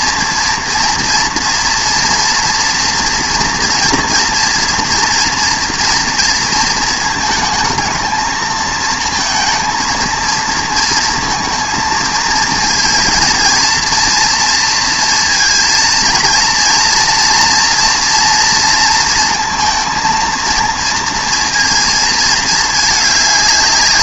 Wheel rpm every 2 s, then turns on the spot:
230, 230, 230, 230, 230, 230, 230, 230, 230, 230, 230, 210.
none